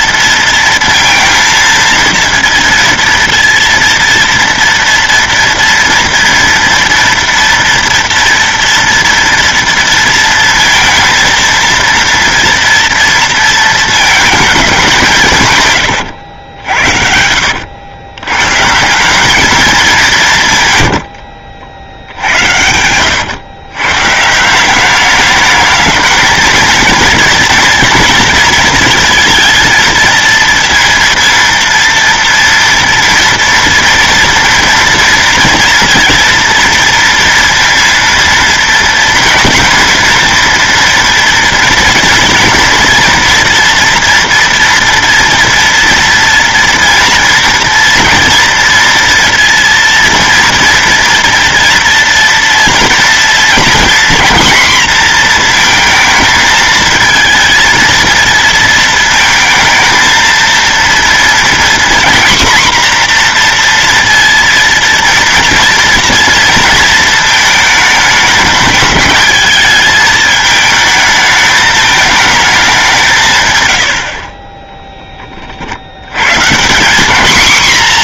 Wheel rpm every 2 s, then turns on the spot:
230, 230, 230, 230, 230, 230, 230, 190, 70, 150, 140, 100, 190, 220, 230, 230, 230, 230, 230, 230, 230, 230, 230, 230, 230, 230, 230, 240, 230, 230, 230, 250, 230, 230, 210, 220, 200, 20, 190.
22-24